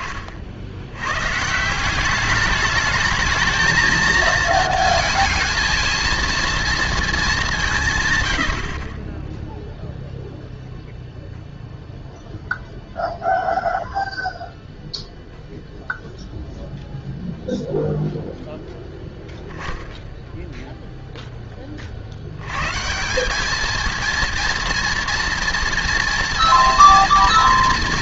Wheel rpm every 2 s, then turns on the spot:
50, 210, 230, 230, 80, 0, 0, 0, 0, 0, 0, 110, 230, 230.
none